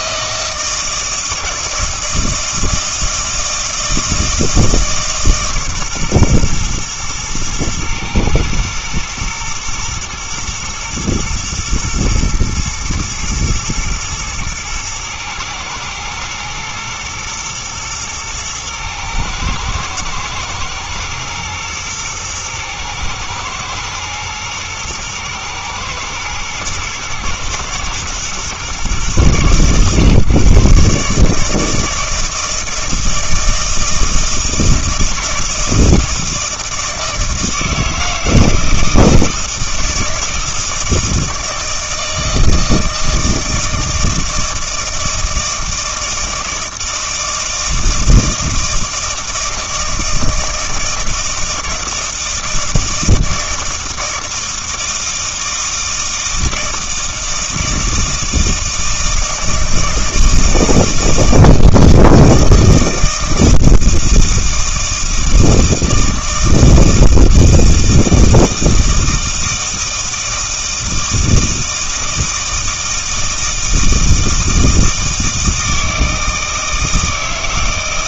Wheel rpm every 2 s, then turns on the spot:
160, 160, 160, 120, 120, 110, 110, 110, 120, 110, 110, 110, 120, 120, 120, 140, 160, 160, 160, 160, 160, 160, 160, 160, 160, 160, 160, 160, 160, 160, 160, 160, 160, 160, 160, 160, 160, 160, 160.
none